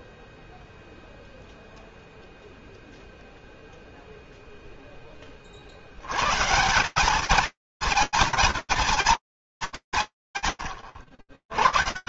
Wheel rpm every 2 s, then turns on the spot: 0, 0, 10, 180, 90, 180.
none